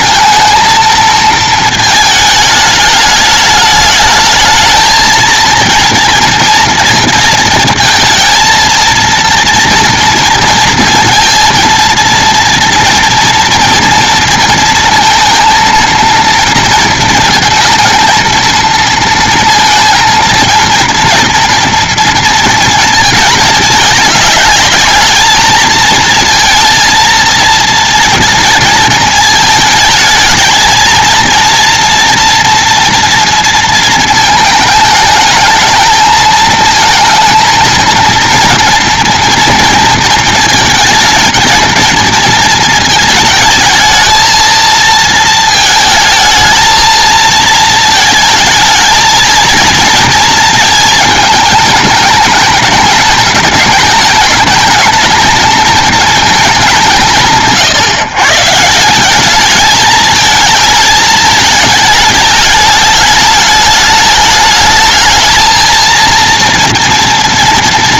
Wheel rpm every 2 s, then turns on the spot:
230, 210, 220, 230, 230, 230, 230, 230, 220, 230, 230, 230, 210, 230, 230, 230, 230, 220, 220, 240, 220, 220, 230, 220, 220, 220, 220, 220, 180, 160, 220, 210, 210, 230.
none